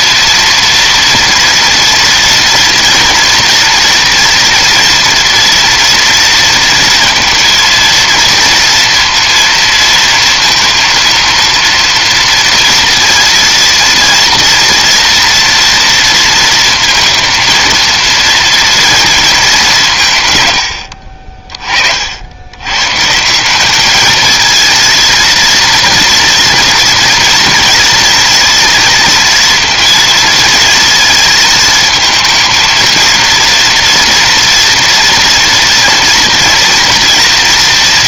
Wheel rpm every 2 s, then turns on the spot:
230, 230, 230, 230, 230, 230, 230, 230, 230, 230, 100, 120, 230, 230, 230, 230, 230, 230, 230.
none